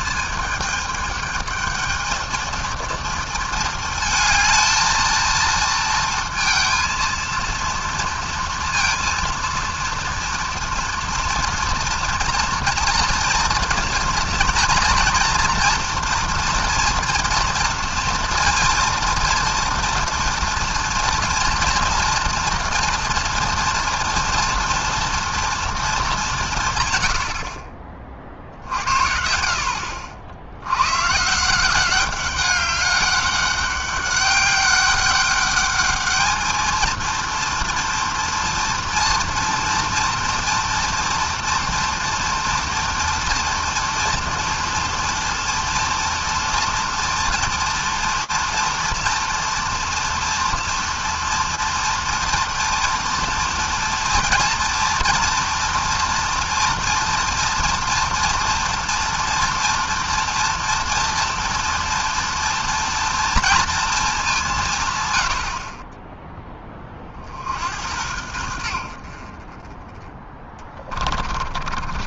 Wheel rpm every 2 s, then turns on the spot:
220, 220, 220, 230, 230, 240, 240, 230, 240, 230, 230, 230, 230, 170, 40, 70, 190, 200, 220, 240, 230, 230, 230, 230, 230, 230, 230, 230, 230, 230, 230, 230, 190, 10, 80, 20.
70-72